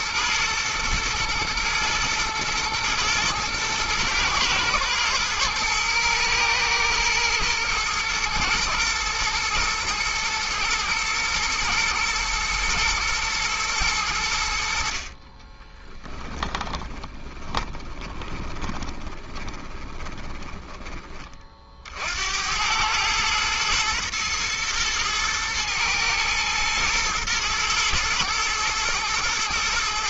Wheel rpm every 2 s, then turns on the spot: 120, 110, 110, 110, 110, 110, 120, 80, 20, 20, 20, 90, 110, 110, 110.
16-22